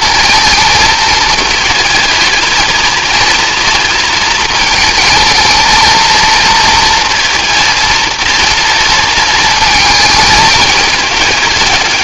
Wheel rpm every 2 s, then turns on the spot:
220, 220, 220, 230, 230, 210.
none